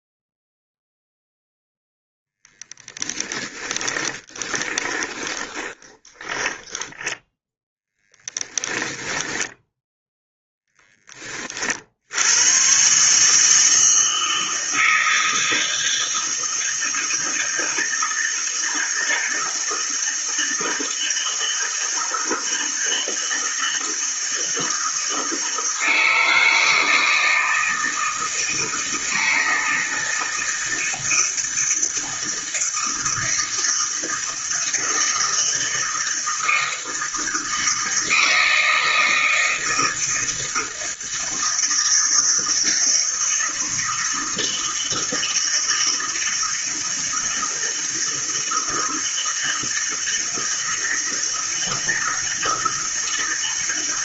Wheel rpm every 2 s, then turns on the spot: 0, 20, 20, 10, 20, 10, 120, 160, 160, 160, 160, 160, 160, 160, 160, 160, 160, 160, 160, 160, 160, 160, 160, 160, 160, 160, 160.
2-10